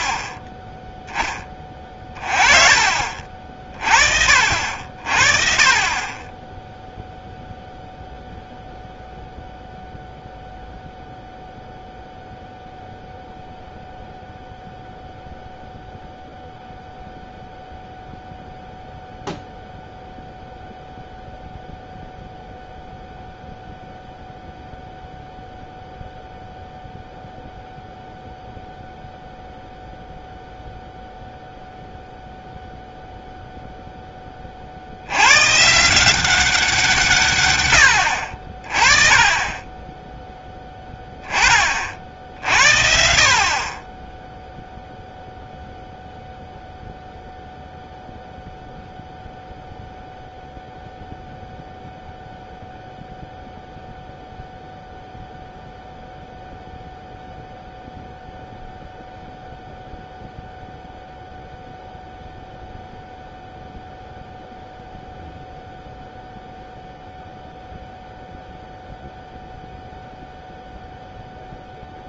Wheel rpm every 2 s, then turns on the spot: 10, 40, 50, 10, 0, 0, 0, 0, 0, 0, 0, 0, 0, 0, 0, 0, 0, 40, 180, 40, 10, 60, 10, 0, 0, 0, 0, 0, 0, 0, 0, 0, 0, 0, 0, 0.
none